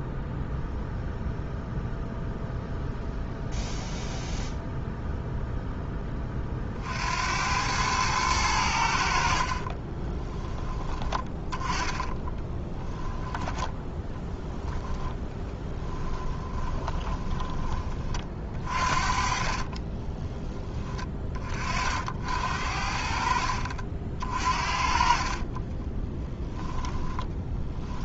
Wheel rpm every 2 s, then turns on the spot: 0, 0, 0, 60, 80, 20, 10, 10, 10, 40, 30, 50, 40, 10.
12-20